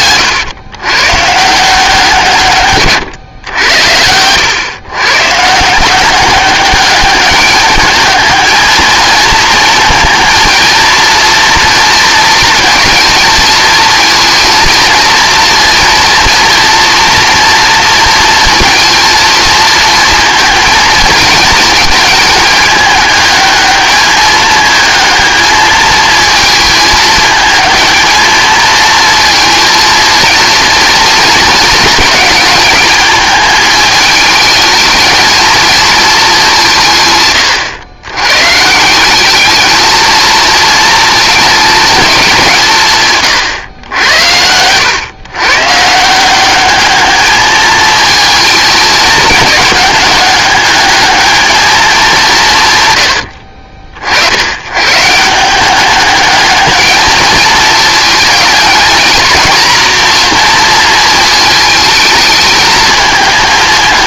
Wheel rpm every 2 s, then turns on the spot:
120, 130, 120, 200, 220, 230, 220, 230, 230, 230, 230, 210, 220, 220, 220, 230, 210, 220, 160, 170, 220, 160, 110, 210, 220, 210, 110, 120, 220, 220, 230, 220.
none